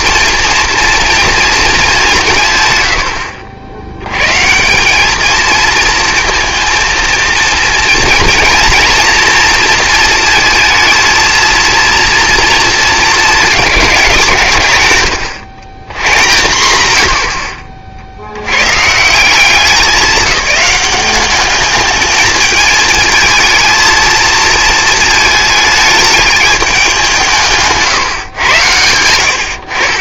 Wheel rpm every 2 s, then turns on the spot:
230, 120, 180, 230, 230, 230, 230, 140, 100, 110, 200, 220, 220, 200, 90.
none